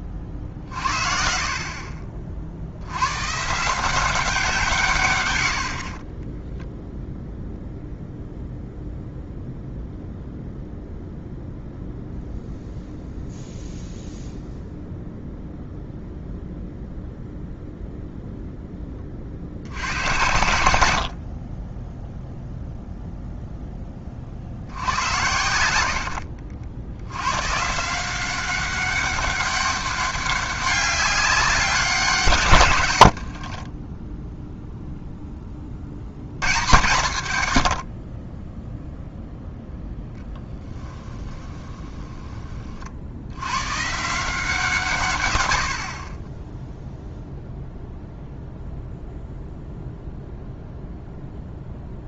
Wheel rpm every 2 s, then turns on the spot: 50, 80, 160, 0, 0, 0, 0, 0, 0, 10, 80, 0, 80, 80, 190, 200, 110, 0, 120, 10, 10, 40, 150, 0, 0, 0.
40-42